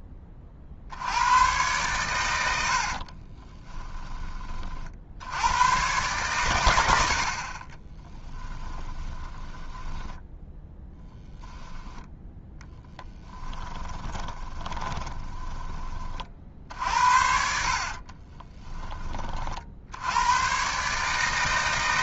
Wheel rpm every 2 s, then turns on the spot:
70, 60, 50, 100, 20, 10, 10, 20, 60, 20, 130.
2-4 8-16